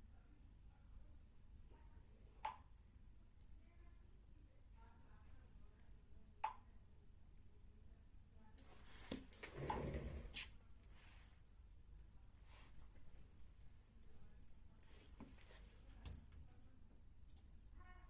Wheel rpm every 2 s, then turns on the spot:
0, 0, 0, 0, 0, 0, 0, 0, 0.
none